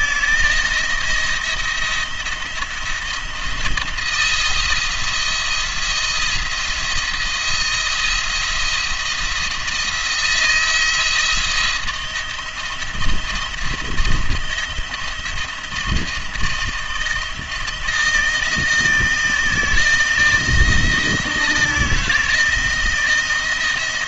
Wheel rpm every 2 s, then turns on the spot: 170, 170, 170, 170, 170, 160, 170, 170, 170, 170, 170, 170.
none